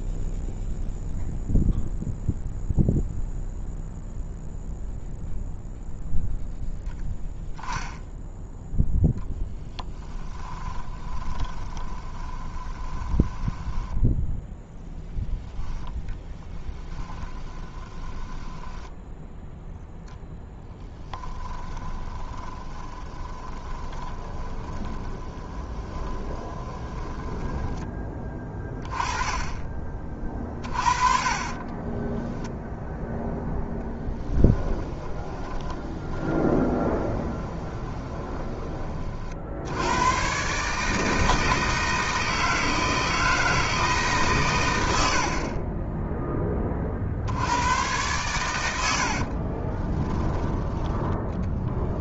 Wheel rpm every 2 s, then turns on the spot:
0, 0, 0, 0, 0, 20, 20, 0, 10, 10, 0, 20, 20, 20, 20, 30, 10, 10, 20, 20, 130, 160, 130, 20, 100, 20.
10-14 16-20 22-28 30-40